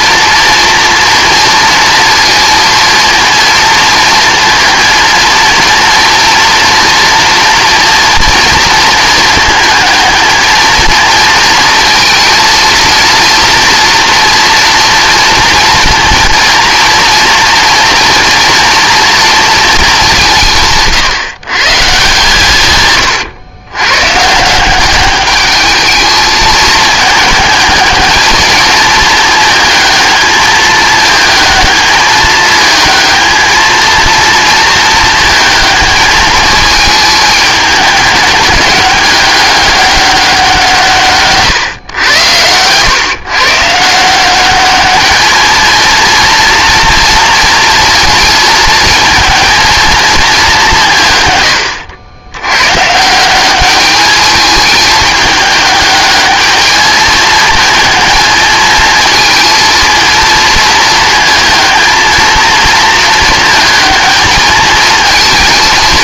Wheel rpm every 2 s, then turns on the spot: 240, 230, 230, 230, 230, 220, 230, 230, 230, 240, 160, 140, 170, 220, 220, 220, 220, 230, 220, 200, 170, 110, 200, 230, 230, 190, 110, 210, 210, 220, 230, 230, 220.
none